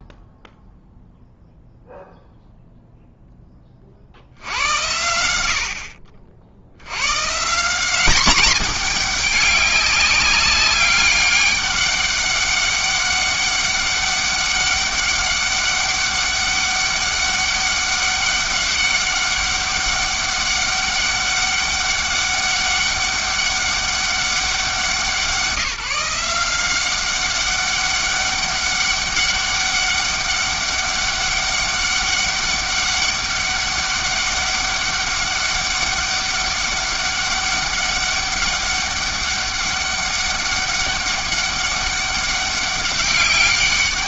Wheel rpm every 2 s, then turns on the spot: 0, 0, 90, 90, 220, 200, 200, 200, 200, 200, 200, 200, 180, 180, 200, 200, 200, 200, 200, 200, 200, 190.
none